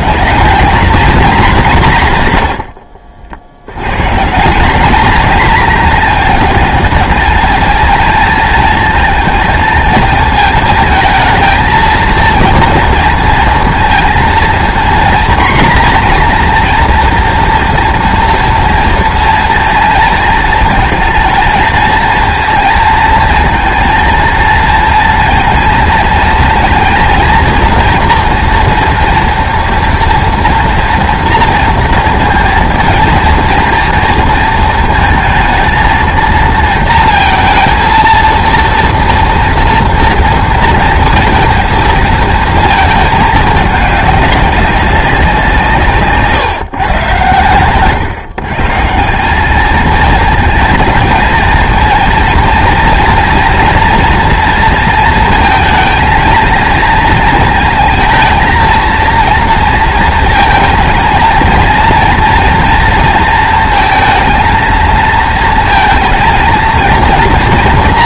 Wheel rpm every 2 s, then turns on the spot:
230, 100, 190, 220, 230, 220, 230, 230, 240, 230, 230, 230, 230, 230, 230, 230, 230, 230, 230, 230, 230, 230, 200, 130, 150, 220, 230, 230, 230, 230, 230, 230, 230, 230.
none